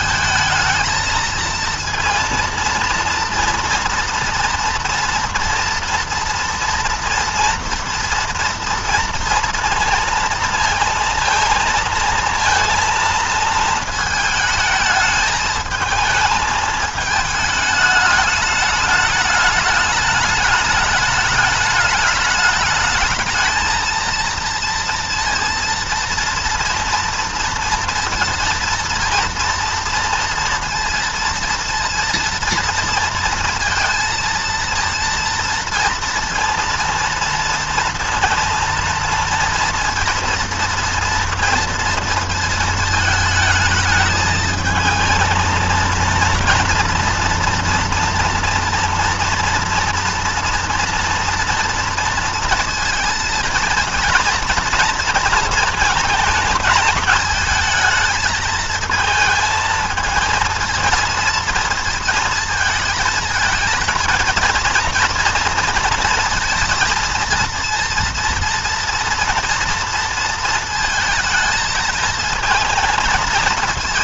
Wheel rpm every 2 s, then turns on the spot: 220, 230, 230, 230, 230, 230, 230, 220, 220, 210, 210, 210, 230, 230, 230, 230, 230, 230, 230, 230, 230, 220, 220, 230, 230, 230, 230, 230, 210, 220, 230, 220, 220, 230, 230, 230, 230.
none